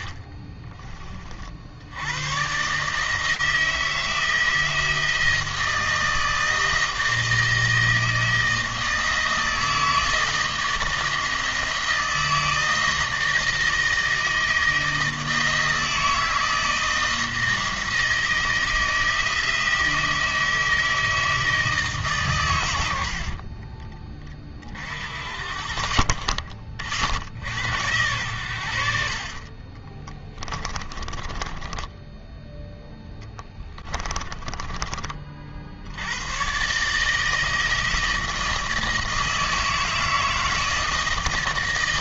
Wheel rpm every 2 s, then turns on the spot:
20, 140, 160, 160, 160, 160, 160, 160, 160, 160, 160, 80, 50, 60, 70, 30, 10, 30, 150, 160, 160.
none